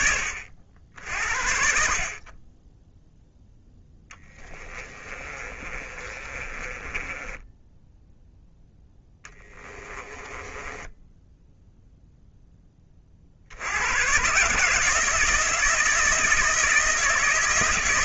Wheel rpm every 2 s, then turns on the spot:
60, 0, 30, 20, 20, 10, 40, 160, 160.
4-12